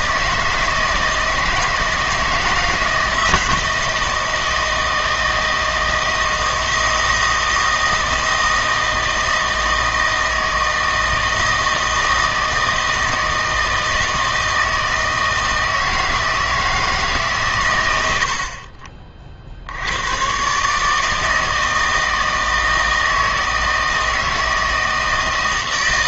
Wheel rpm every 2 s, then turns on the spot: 160, 160, 160, 160, 160, 160, 160, 160, 160, 40, 150, 160, 160.
none